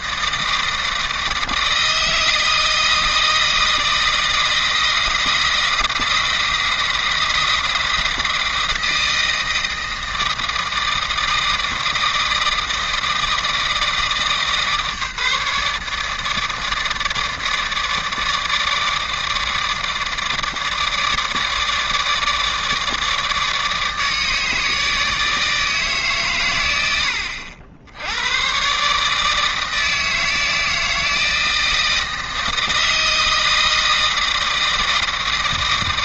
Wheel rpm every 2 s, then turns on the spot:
160, 160, 160, 170, 160, 160, 160, 150, 150, 150, 150, 150, 160, 100, 140, 160, 160, 160.
none